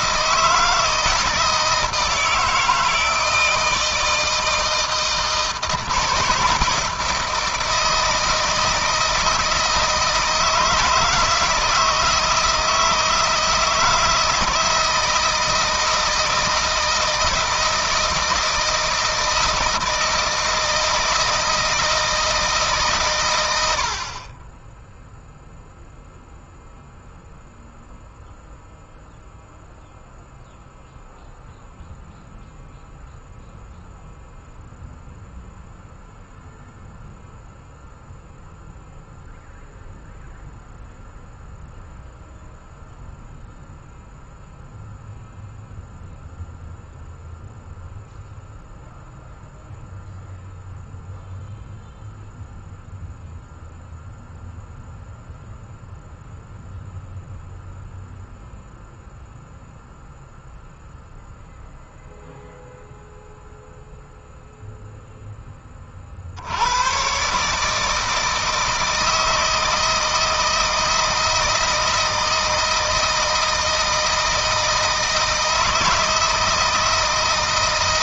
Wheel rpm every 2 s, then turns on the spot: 160, 160, 160, 160, 160, 160, 160, 160, 160, 160, 160, 130, 0, 0, 0, 0, 0, 0, 0, 0, 0, 0, 0, 0, 0, 0, 0, 0, 0, 0, 0, 0, 0, 110, 160, 160, 160, 160, 160.
none